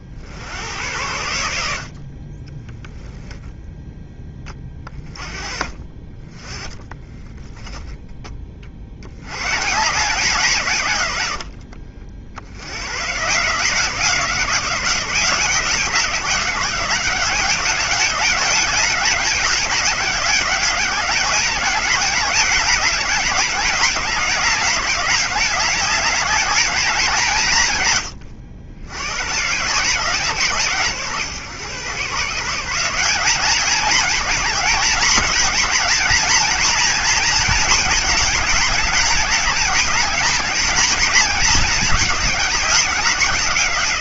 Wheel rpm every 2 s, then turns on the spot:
80, 10, 20, 10, 50, 140, 100, 180, 190, 200, 190, 200, 200, 200, 80, 140, 170, 220, 230, 210, 220, 200.
2-4